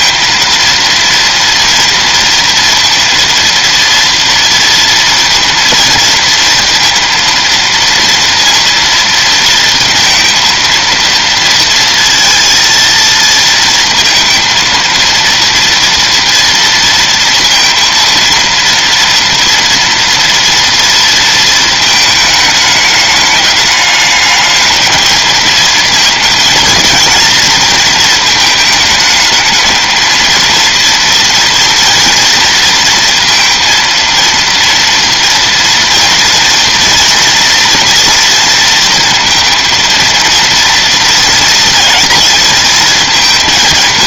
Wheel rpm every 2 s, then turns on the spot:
230, 230, 230, 230, 230, 230, 230, 230, 230, 230, 230, 210, 220, 230, 220, 230, 230, 230, 230, 230, 230, 230.
none